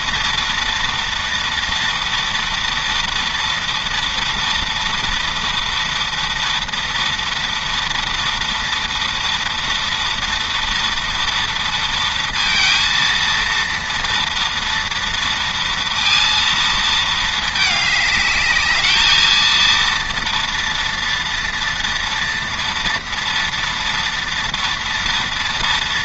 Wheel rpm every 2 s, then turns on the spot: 230, 230, 230, 230, 230, 230, 230, 230, 230, 220, 230, 230, 230.
none